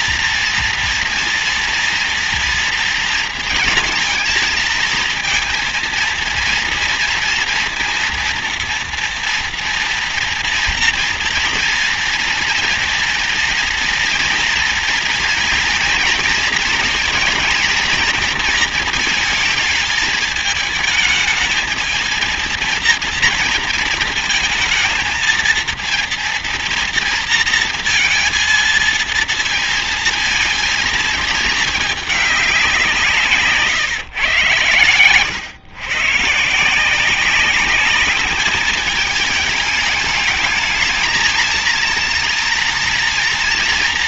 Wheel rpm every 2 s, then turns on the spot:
230, 230, 230, 230, 230, 230, 240, 230, 230, 230, 220, 230, 230, 230, 230, 220, 160, 120, 190, 210, 230, 230.
none